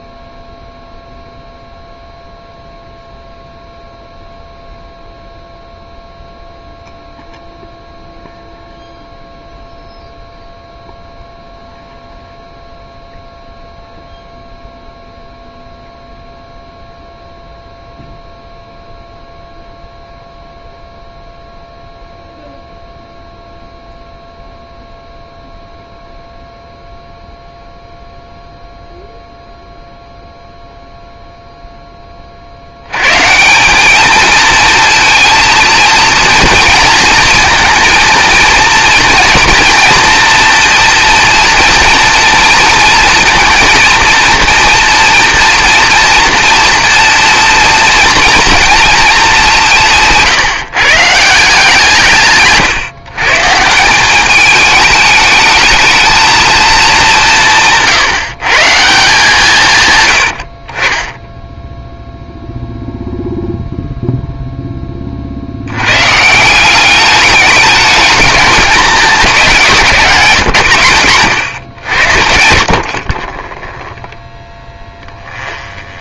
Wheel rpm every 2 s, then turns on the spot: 0, 0, 0, 0, 0, 0, 0, 0, 0, 0, 0, 0, 0, 0, 0, 0, 80, 230, 230, 240, 230, 230, 230, 230, 230, 150, 130, 210, 210, 160, 30, 0, 10, 190, 210, 100, 60, 10.
72-76